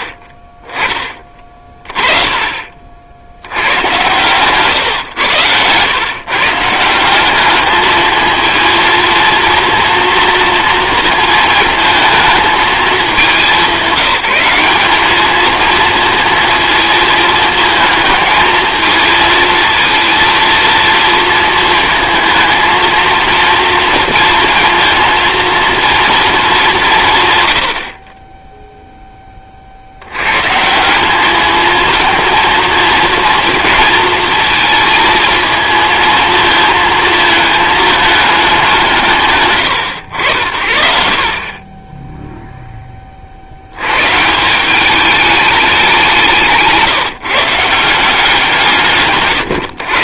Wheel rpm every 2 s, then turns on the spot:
40, 60, 120, 170, 230, 220, 210, 200, 230, 220, 230, 230, 220, 190, 0, 160, 220, 220, 220, 180, 70, 10, 190, 160, 160.
none